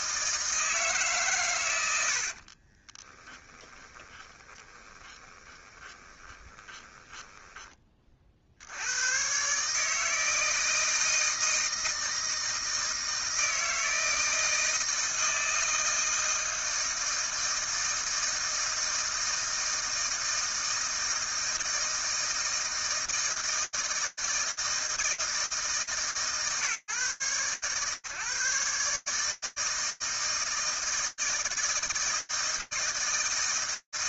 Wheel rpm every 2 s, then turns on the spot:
120, 10, 20, 10, 130, 160, 160, 160, 160, 160, 160, 160, 160, 130, 150, 160, 160.
2-8